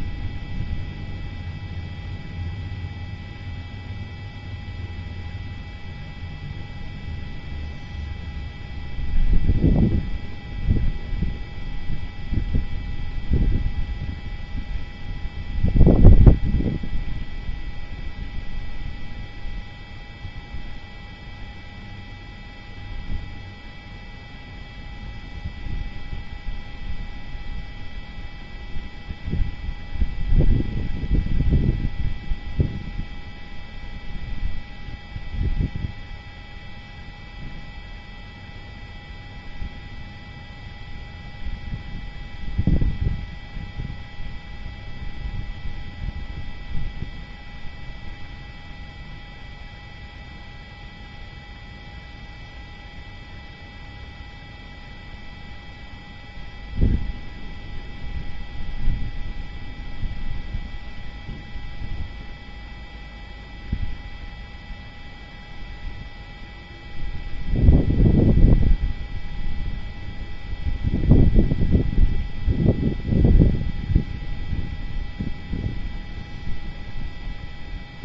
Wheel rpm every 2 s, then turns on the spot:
0, 0, 0, 0, 0, 0, 0, 0, 0, 0, 0, 0, 0, 0, 0, 0, 0, 0, 0, 0, 0, 0, 0, 0, 0, 0, 0, 0, 0, 0, 0, 0, 0, 0, 0, 0, 0, 0, 0.
none